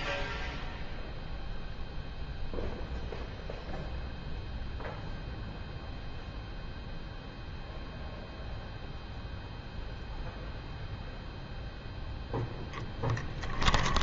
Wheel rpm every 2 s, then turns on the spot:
0, 0, 0, 0, 0, 0, 0.
none